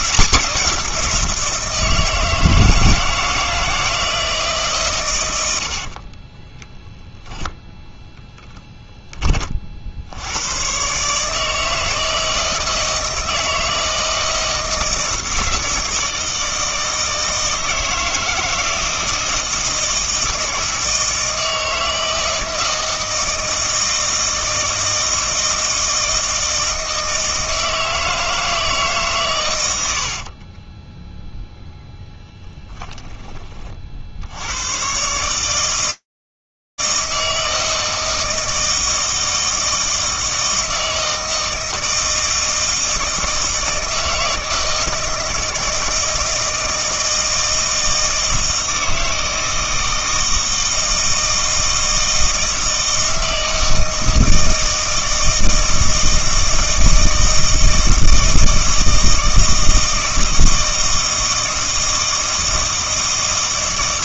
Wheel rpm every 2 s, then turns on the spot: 180, 160, 150, 10, 10, 110, 160, 160, 160, 160, 160, 160, 160, 160, 160, 20, 0, 90, 160, 160, 160, 160, 160, 160, 160, 160, 160, 160, 160, 160, 160, 160.
30-32